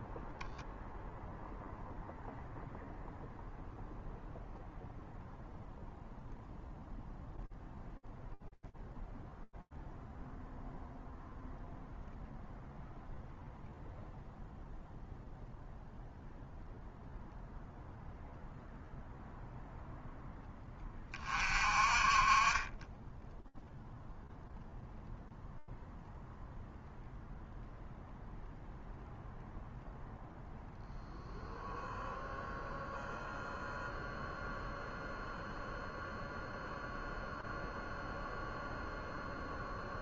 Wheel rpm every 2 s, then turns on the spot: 0, 0, 0, 0, 0, 0, 0, 0, 0, 0, 20, 0, 0, 0, 0, 0, 0, 0, 0, 0.
none